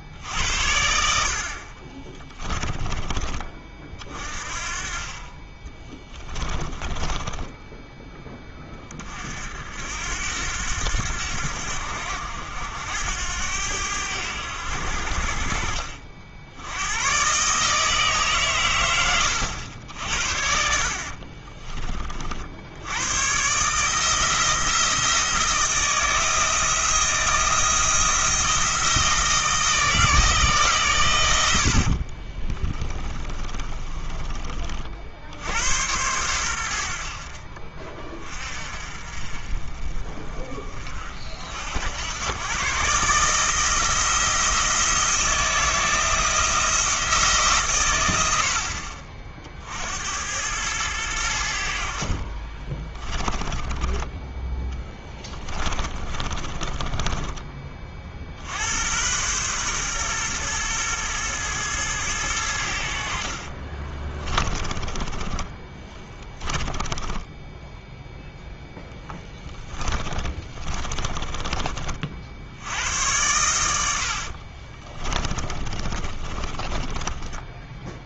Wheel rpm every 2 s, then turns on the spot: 70, 20, 30, 10, 30, 90, 80, 70, 100, 110, 60, 90, 160, 160, 160, 140, 30, 50, 80, 40, 40, 130, 160, 160, 50, 100, 20, 10, 20, 90, 110, 70, 20, 10, 0, 20, 80, 30, 20.
2-4 6-8 32-34 52-58 64-68 70-72 74-78